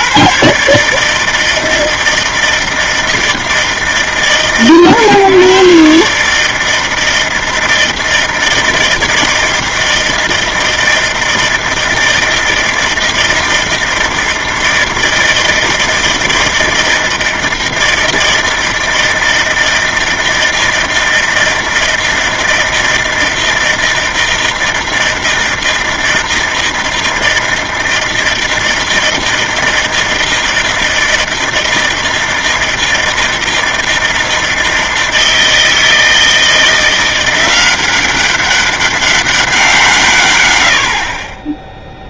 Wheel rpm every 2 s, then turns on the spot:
150, 160, 130, 160, 160, 160, 160, 160, 160, 160, 160, 160, 160, 160, 160, 160, 160, 160, 170, 200, 90.
none